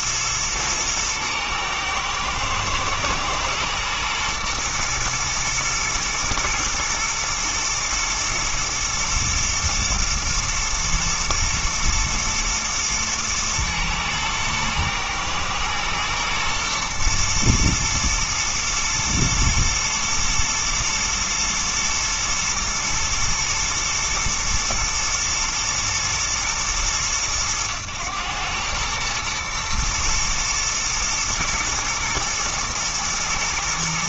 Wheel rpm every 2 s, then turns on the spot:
110, 120, 120, 110, 110, 120, 120, 110, 120, 110, 110, 120, 110, 110, 110, 110, 110.
none